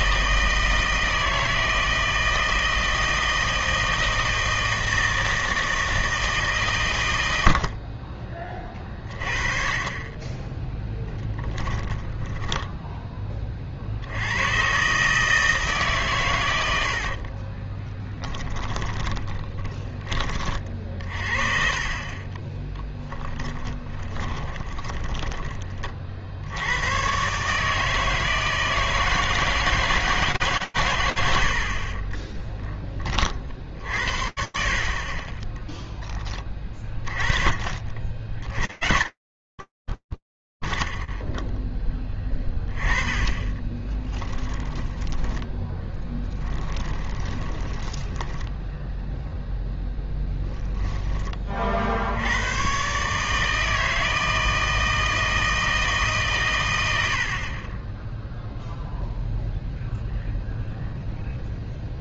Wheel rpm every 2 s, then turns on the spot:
160, 160, 160, 140, 30, 20, 10, 120, 100, 10, 40, 30, 30, 80, 160, 120, 10, 60, 30, 90, 70, 10, 20, 10, 10, 10, 100, 160, 130, 0, 0.
10-14 16-20 22-26 44-52